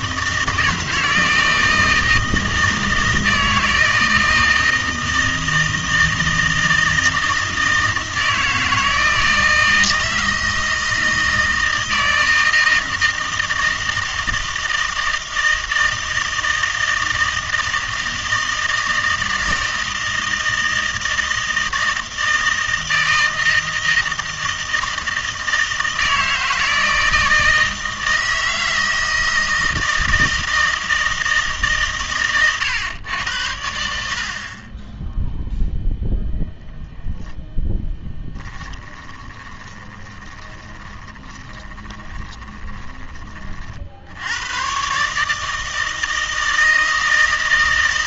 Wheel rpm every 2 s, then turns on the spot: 160, 160, 160, 160, 160, 160, 160, 160, 160, 160, 160, 160, 160, 160, 160, 160, 110, 30, 0, 10, 20, 20, 110, 160.
38-44